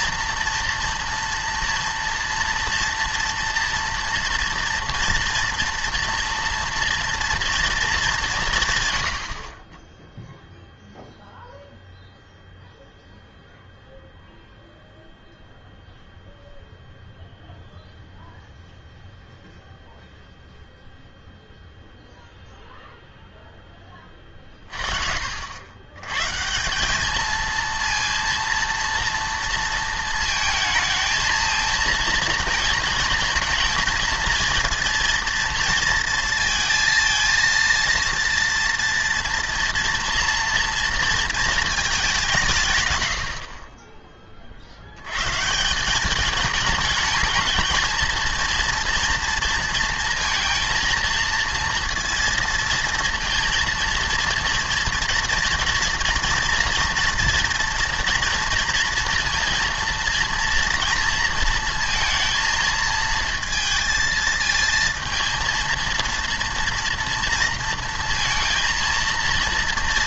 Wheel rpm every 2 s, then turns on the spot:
240, 230, 230, 230, 140, 0, 0, 0, 0, 0, 0, 0, 40, 180, 230, 220, 230, 230, 220, 230, 230, 170, 60, 220, 230, 230, 230, 230, 240, 230, 230, 230, 230, 230, 230.
none